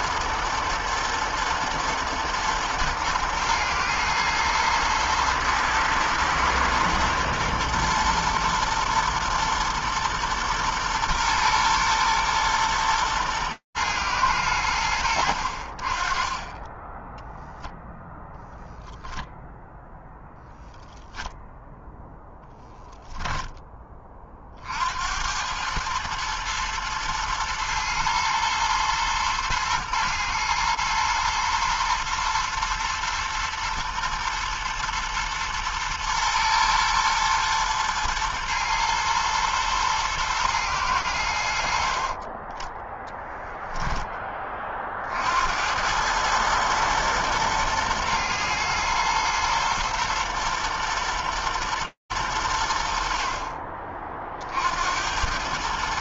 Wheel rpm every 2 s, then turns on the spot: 120, 120, 110, 120, 120, 120, 120, 100, 20, 0, 0, 0, 30, 110, 110, 110, 120, 110, 110, 110, 120, 30, 10, 110, 120, 120, 100, 50.
42-44